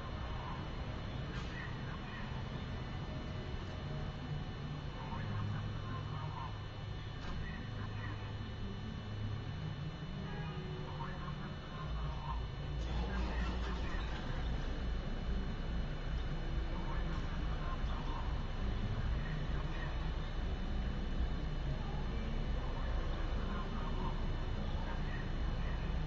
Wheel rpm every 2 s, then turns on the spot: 0, 0, 0, 0, 0, 0, 0, 0, 0, 0, 0, 0, 0.
none